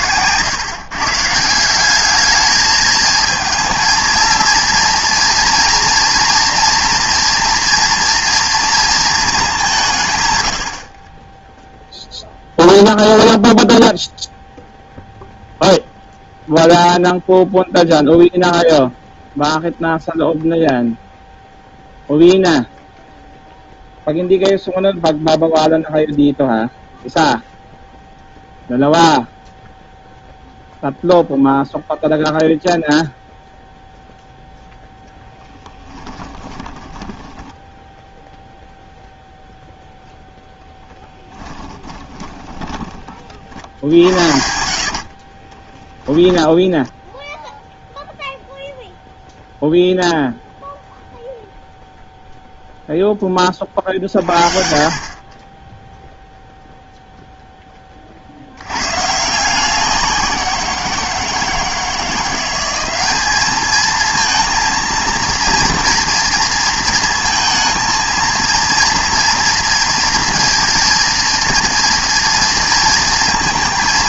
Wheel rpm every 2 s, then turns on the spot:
150, 220, 230, 240, 230, 40, 0, 0, 0, 0, 0, 0, 0, 0, 0, 0, 0, 0, 10, 0, 10, 20, 60, 10, 0, 0, 0, 50, 0, 90, 170, 190, 230, 230, 230, 230, 230.
36-38 42-48